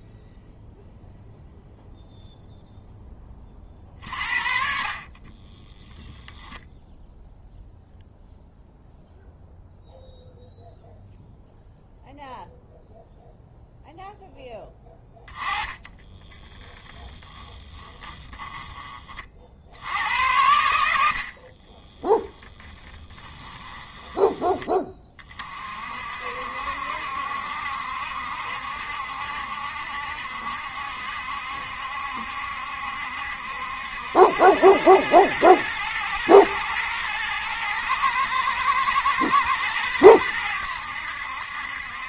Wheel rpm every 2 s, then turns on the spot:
0, 0, 50, 0, 0, 0, 0, 10, 10, 10, 80, 10, 20, 70, 70, 70, 70, 100, 110, 110, 90.
16-18 22-24